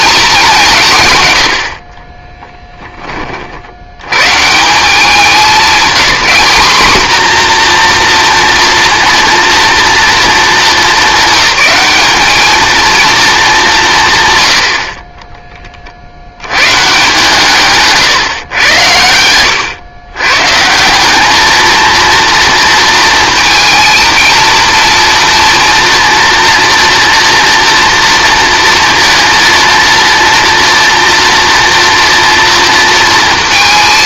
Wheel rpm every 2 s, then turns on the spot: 180, 10, 160, 230, 230, 210, 220, 80, 150, 110, 150, 230, 230, 230, 230, 230, 230.
none